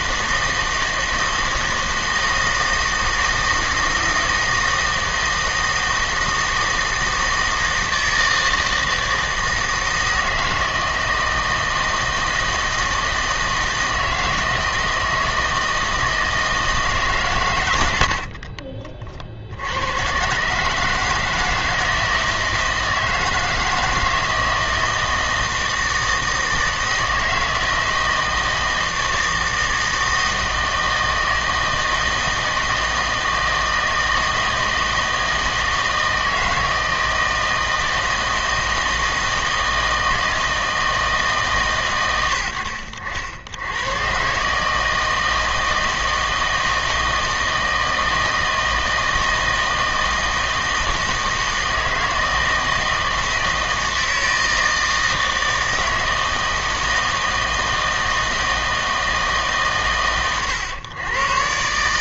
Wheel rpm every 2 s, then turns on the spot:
160, 160, 160, 160, 160, 160, 160, 160, 160, 30, 140, 160, 160, 160, 160, 160, 160, 160, 160, 160, 160, 80, 150, 160, 160, 160, 160, 160, 160, 160, 120.
none